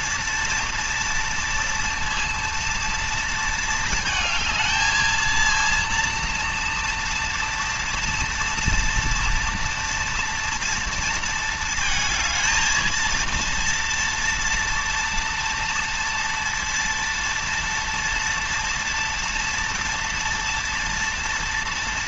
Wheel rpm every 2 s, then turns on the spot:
230, 230, 220, 230, 230, 230, 230, 230, 230, 230, 230.
none